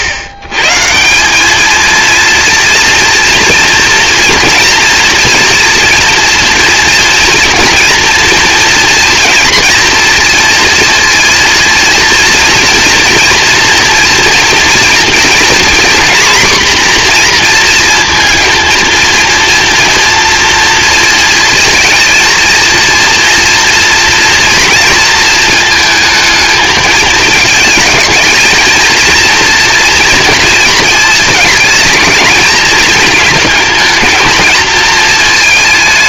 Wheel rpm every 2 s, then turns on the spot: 140, 230, 230, 230, 230, 230, 230, 230, 250, 230, 230, 230, 230, 220, 220, 230, 220, 220.
none